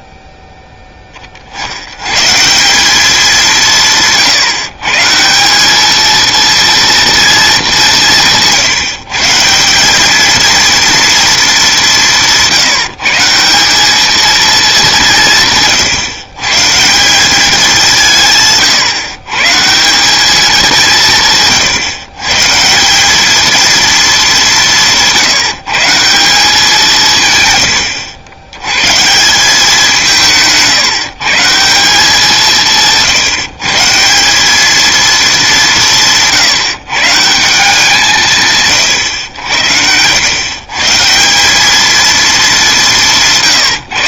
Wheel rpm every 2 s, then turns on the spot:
20, 180, 130, 230, 160, 230, 160, 200, 150, 130, 180, 170, 160, 170, 120, 160, 170, 220, 140, 140, 140, 200.
none